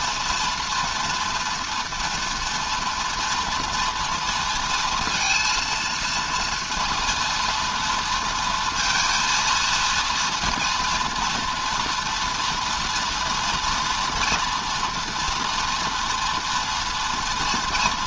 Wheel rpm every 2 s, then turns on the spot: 230, 230, 230, 230, 230, 240, 230, 230, 230.
none